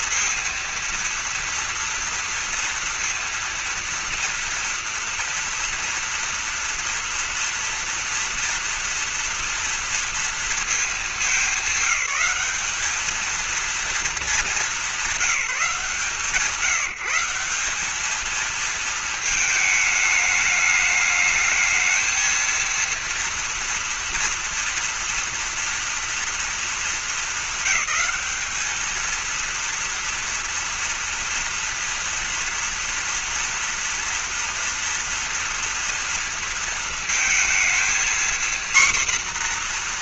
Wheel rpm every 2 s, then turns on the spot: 230, 230, 230, 230, 230, 220, 200, 210, 160, 230, 210, 230, 230, 230, 220, 230, 230, 230, 230, 240.
none